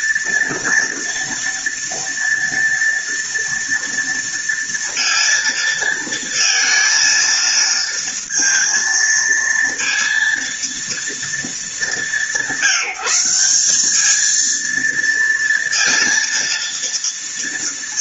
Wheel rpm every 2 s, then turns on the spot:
230, 230, 230, 230, 230, 230, 170, 230, 230.
none